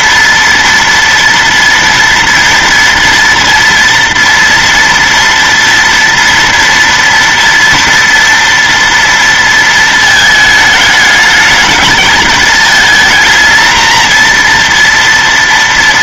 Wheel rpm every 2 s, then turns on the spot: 230, 230, 230, 230, 230, 220, 220, 230.
none